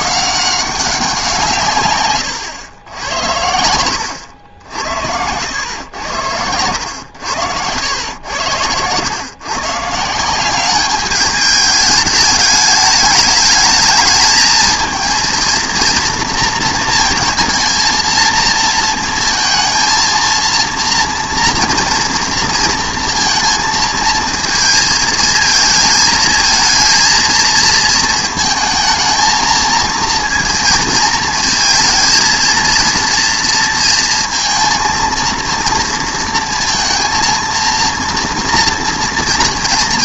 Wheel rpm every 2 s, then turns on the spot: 190, 110, 80, 100, 100, 190, 210, 220, 230, 230, 240, 230, 230, 230, 220, 230, 230, 230, 230, 240.
4-6